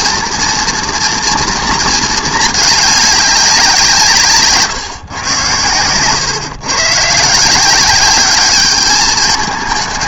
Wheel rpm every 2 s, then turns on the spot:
240, 210, 150, 130, 200.
none